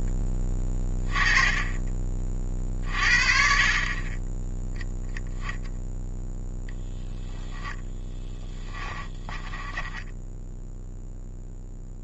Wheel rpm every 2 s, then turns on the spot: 20, 40, 10, 0, 10, 0.
8-10